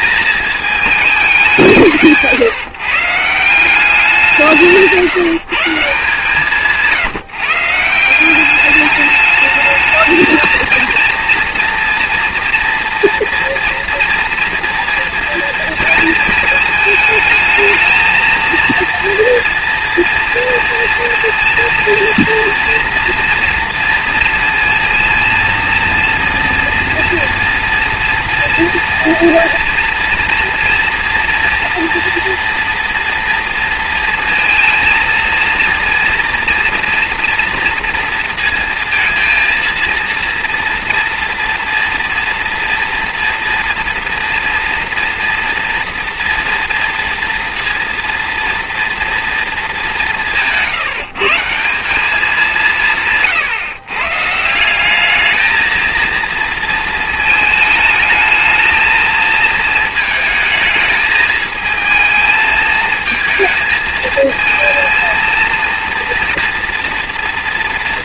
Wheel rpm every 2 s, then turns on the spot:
210, 160, 160, 160, 210, 230, 230, 230, 220, 240, 230, 230, 230, 230, 230, 230, 230, 230, 230, 230, 230, 240, 230, 230, 230, 160, 150, 210, 220, 220, 220, 220, 230, 230.
none